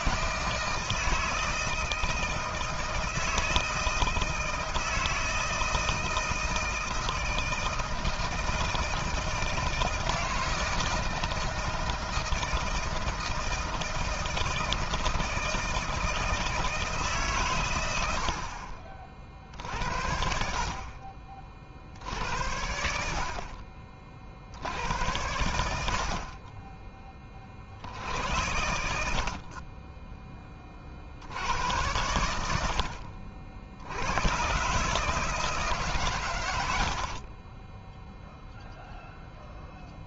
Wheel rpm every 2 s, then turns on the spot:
160, 160, 160, 160, 160, 160, 160, 160, 150, 50, 50, 60, 70, 20, 70, 50, 60, 130, 80, 0.
36-38